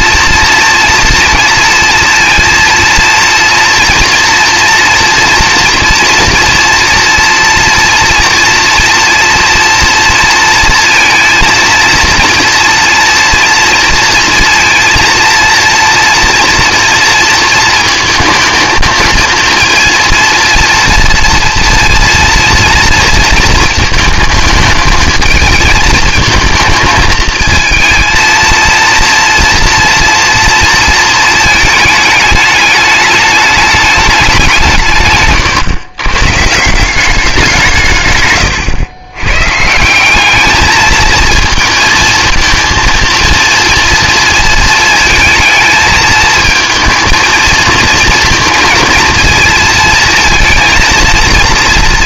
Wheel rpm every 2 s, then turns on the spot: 230, 230, 230, 230, 240, 230, 230, 230, 240, 220, 230, 230, 220, 220, 230, 230, 210, 170, 150, 120, 210, 220, 230, 220, 230, 230.
none